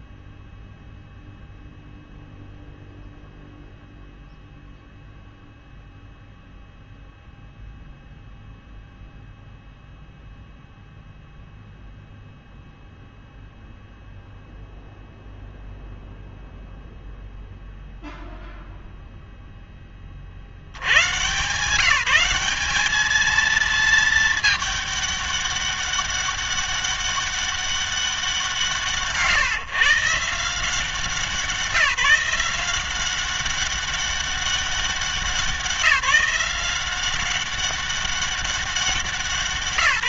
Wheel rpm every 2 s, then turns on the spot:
0, 0, 0, 0, 0, 0, 0, 0, 0, 0, 90, 210, 210, 200, 160, 170, 180, 200, 180, 200.
none